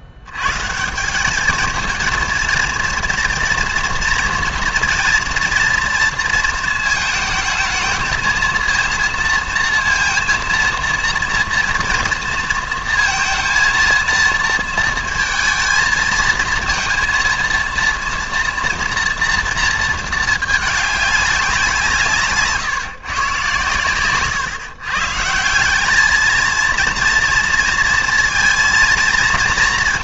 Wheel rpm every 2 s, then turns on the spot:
150, 230, 230, 230, 230, 230, 230, 230, 230, 230, 210, 140, 130, 230, 230.
none